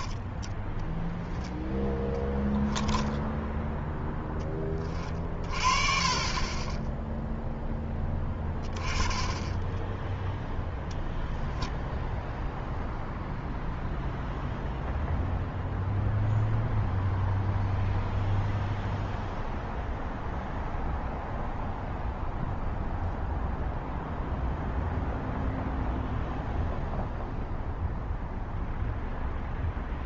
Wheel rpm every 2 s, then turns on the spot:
0, 0, 30, 0, 20, 10, 0, 0, 0, 0, 0, 0, 0, 0, 0.
10-12